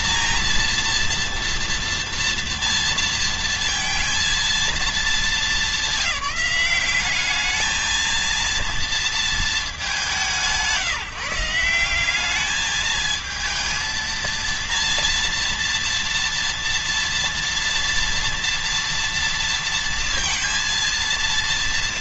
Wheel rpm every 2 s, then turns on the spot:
230, 230, 230, 190, 230, 170, 200, 230, 230, 230, 230.
none